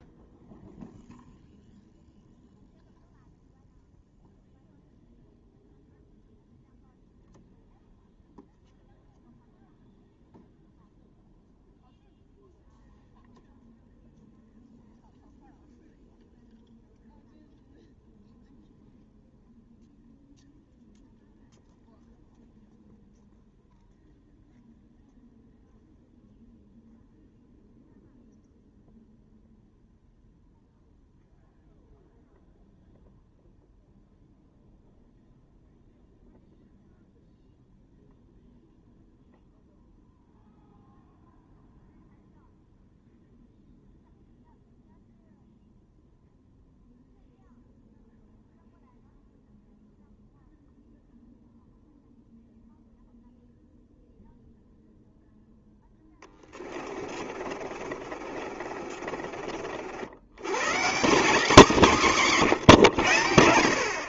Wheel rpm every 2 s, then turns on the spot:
0, 0, 0, 0, 0, 0, 0, 0, 0, 0, 0, 0, 0, 0, 0, 0, 0, 0, 0, 0, 0, 0, 0, 0, 0, 0, 0, 0, 10, 30, 80, 160.
56-60